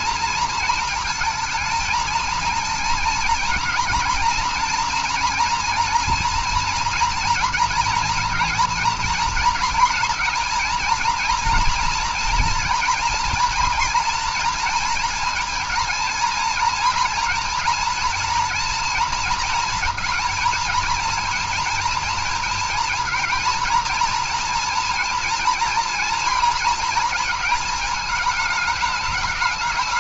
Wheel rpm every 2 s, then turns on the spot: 230, 230, 230, 230, 230, 230, 240, 230, 230, 230, 230, 220, 230, 230, 220.
none